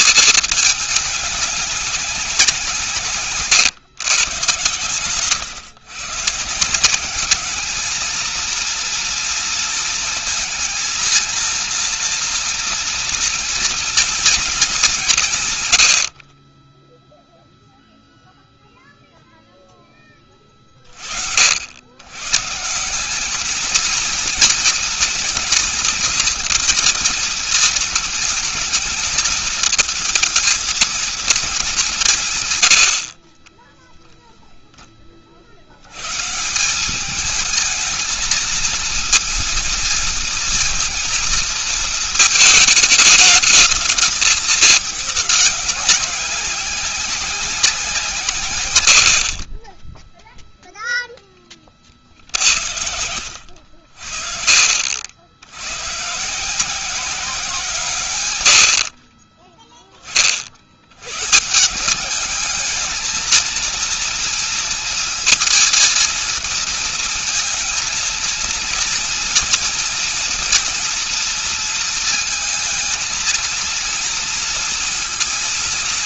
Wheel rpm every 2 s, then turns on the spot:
210, 150, 120, 190, 230, 230, 230, 180, 10, 0, 30, 180, 230, 230, 220, 220, 70, 20, 200, 230, 230, 220, 210, 190, 60, 0, 80, 60, 180, 60, 100, 220, 230, 230, 230, 230, 230, 230.
16-18